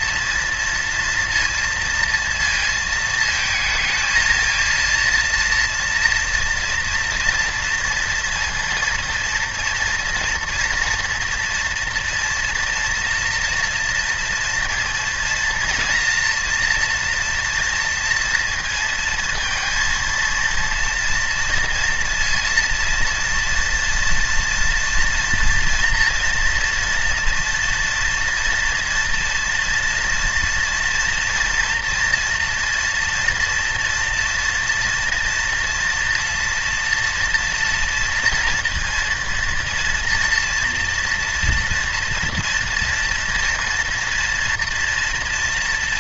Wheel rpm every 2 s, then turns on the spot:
230, 220, 230, 230, 230, 240, 230, 230, 240, 230, 230, 230, 230, 240, 230, 230, 230, 230, 240, 230, 240, 230, 230.
none